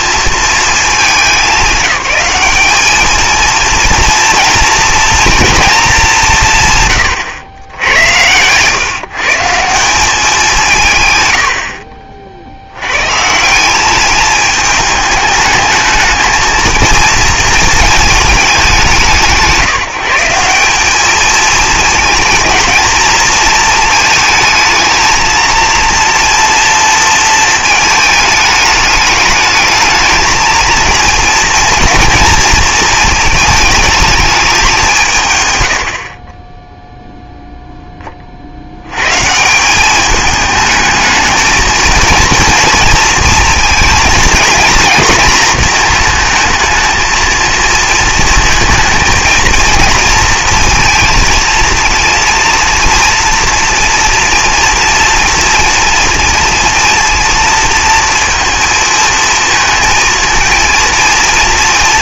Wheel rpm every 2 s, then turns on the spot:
220, 200, 230, 140, 120, 160, 90, 210, 230, 210, 190, 220, 220, 230, 210, 220, 230, 190, 10, 90, 220, 230, 220, 220, 230, 230, 230, 230, 230, 230, 230.
none